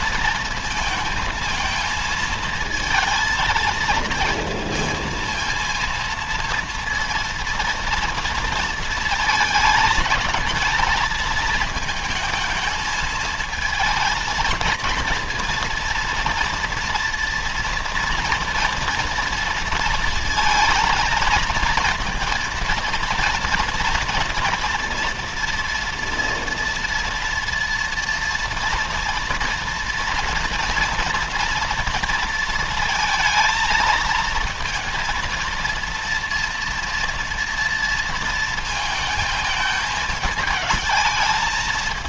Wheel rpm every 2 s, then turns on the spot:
230, 220, 220, 230, 220, 220, 220, 230, 230, 230, 220, 230, 230, 240, 230, 240, 230, 230, 230, 220, 220.
none